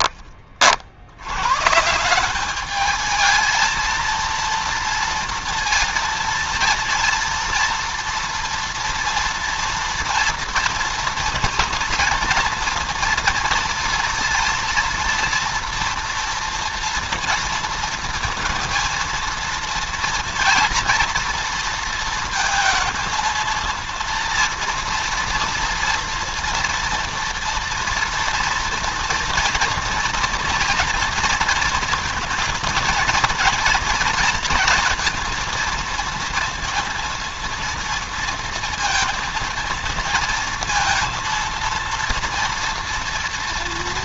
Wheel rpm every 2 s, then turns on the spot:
60, 210, 230, 230, 230, 230, 230, 230, 230, 230, 240, 220, 230, 230, 230, 230, 230, 230, 230, 230, 230, 230.
none